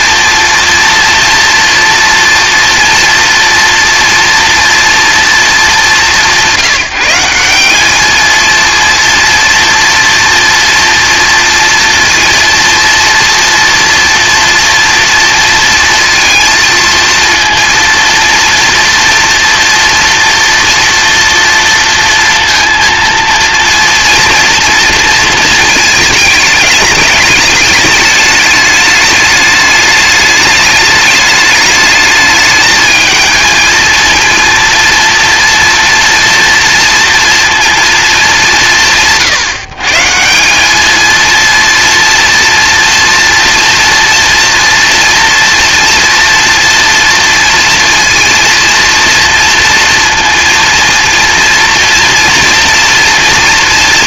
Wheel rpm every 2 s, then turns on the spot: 230, 230, 240, 180, 230, 240, 230, 230, 230, 230, 230, 230, 230, 210, 210, 210, 220, 230, 230, 160, 210, 230, 230, 230, 230, 230, 230.
none